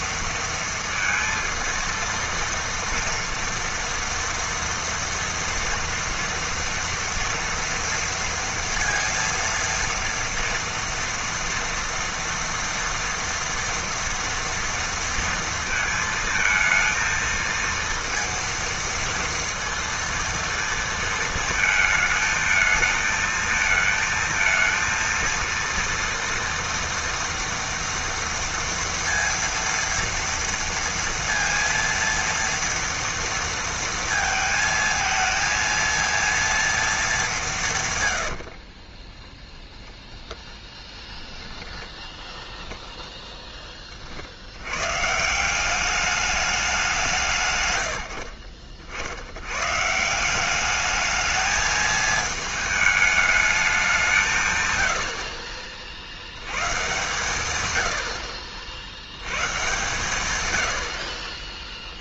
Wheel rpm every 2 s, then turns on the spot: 230, 230, 230, 230, 230, 230, 230, 230, 230, 230, 230, 220, 230, 230, 230, 230, 230, 220, 230, 40, 10, 10, 110, 180, 50, 200, 220, 110, 110, 60, 80.
38-42